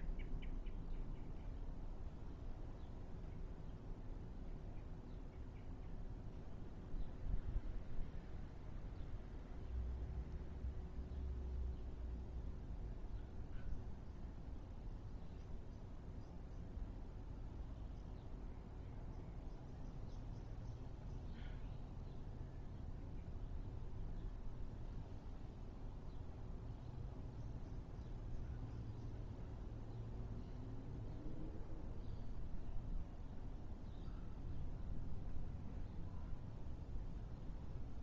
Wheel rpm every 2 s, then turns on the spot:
0, 0, 0, 0, 0, 0, 0, 0, 0, 0, 0, 0, 0, 0, 0, 0, 0, 0, 0.
none